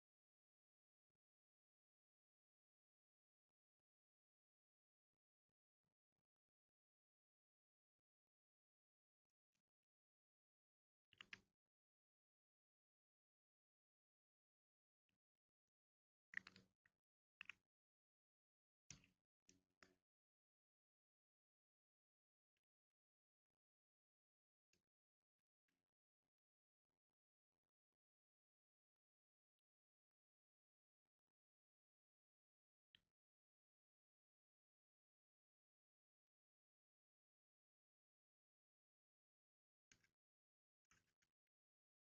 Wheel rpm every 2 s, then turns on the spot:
0, 0, 0, 0, 0, 0, 0, 0, 0, 0, 0, 0, 0, 0, 0, 0, 0, 0, 0, 0, 0.
none